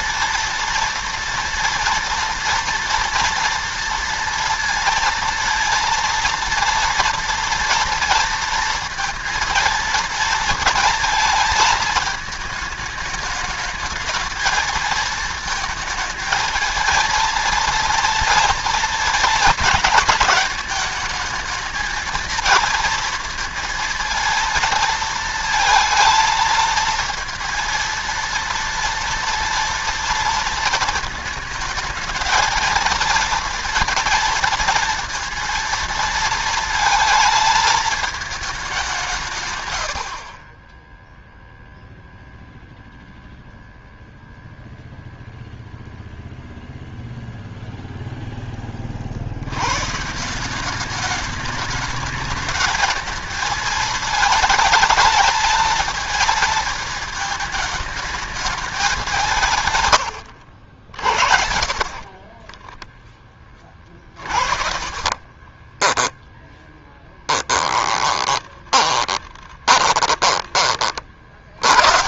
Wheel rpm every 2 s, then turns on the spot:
230, 230, 230, 230, 230, 230, 210, 220, 220, 230, 210, 230, 230, 230, 230, 230, 230, 230, 230, 190, 20, 0, 0, 0, 20, 190, 220, 220, 220, 210, 70, 10, 50, 10, 20, 40.
62-70